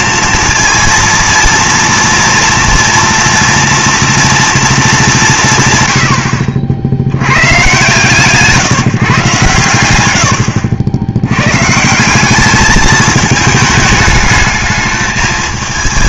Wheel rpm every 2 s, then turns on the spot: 230, 230, 220, 70, 150, 80, 210, 210.
none